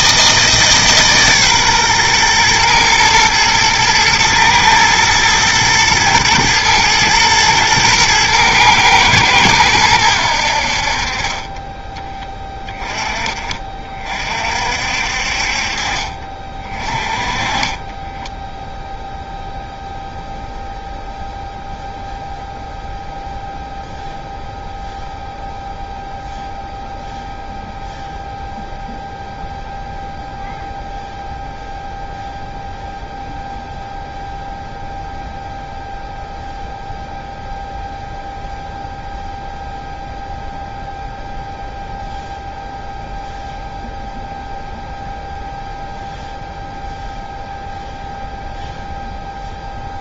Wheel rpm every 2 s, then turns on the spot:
160, 120, 120, 110, 110, 70, 20, 50, 30, 0, 0, 0, 0, 0, 0, 0, 0, 0, 0, 0, 0, 0, 0, 0, 0.
none